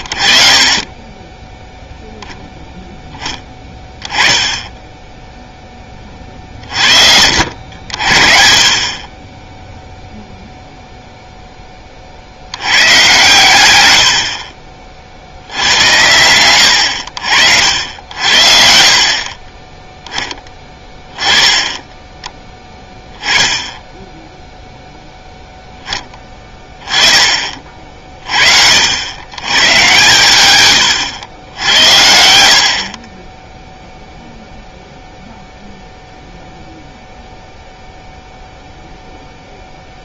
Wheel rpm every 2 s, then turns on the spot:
30, 10, 10, 40, 50, 0, 100, 30, 90, 60, 10, 10, 0, 20, 60, 110, 50, 0, 0, 0.
30-32